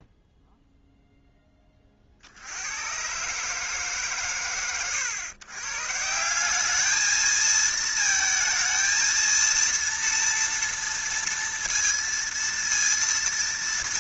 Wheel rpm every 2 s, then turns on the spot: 0, 120, 110, 220, 230, 230, 230.
none